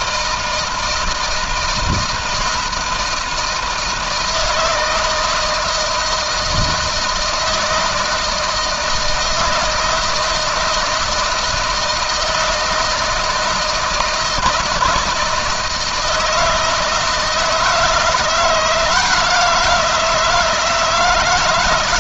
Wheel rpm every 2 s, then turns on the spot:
160, 160, 160, 160, 160, 160, 160, 170, 160, 170, 160.
none